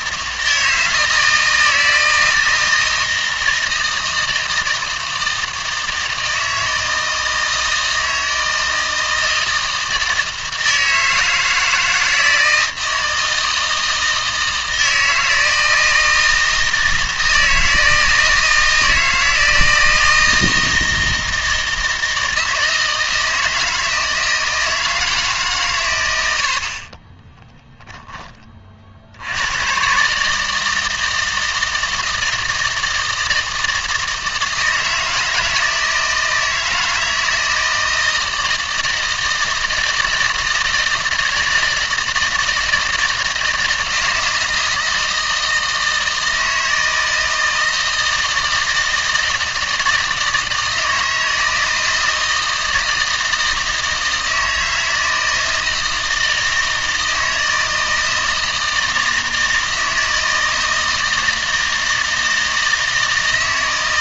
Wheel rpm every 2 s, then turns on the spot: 160, 160, 160, 160, 160, 160, 160, 160, 160, 160, 160, 160, 160, 40, 50, 160, 160, 160, 160, 160, 160, 160, 160, 160, 160, 160, 160, 160, 160, 160, 160, 160.
none